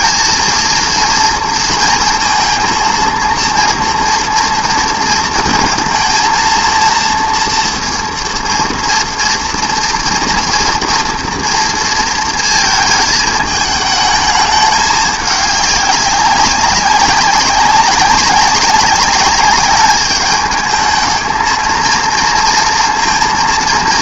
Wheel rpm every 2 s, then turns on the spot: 230, 230, 230, 230, 230, 240, 230, 210, 190, 200, 210, 230.
none